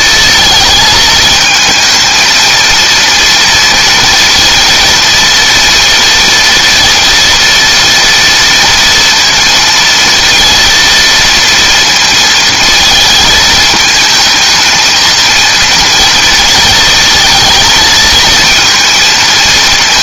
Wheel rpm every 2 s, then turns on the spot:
220, 230, 230, 230, 230, 230, 220, 220, 230, 220.
none